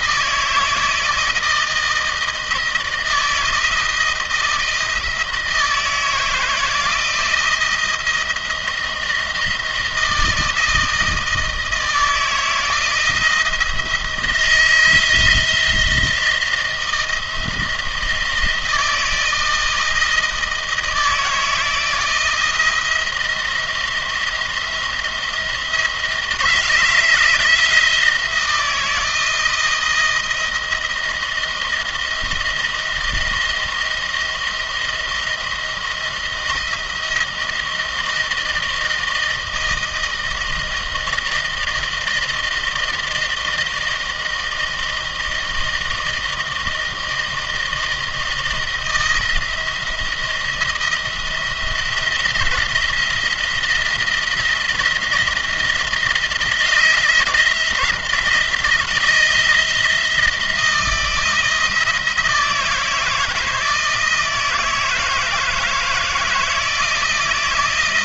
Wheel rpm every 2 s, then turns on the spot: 160, 160, 160, 160, 170, 160, 160, 170, 170, 160, 160, 170, 170, 160, 170, 160, 160, 170, 160, 160, 160, 160, 160, 160, 170, 170, 170, 170, 160, 170, 170, 160, 160, 160.
none